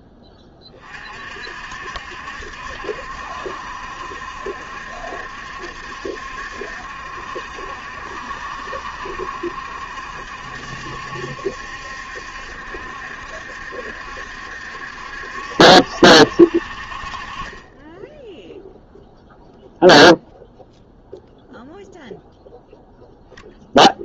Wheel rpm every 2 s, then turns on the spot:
40, 70, 70, 70, 70, 70, 70, 70, 50, 0, 0, 0.
none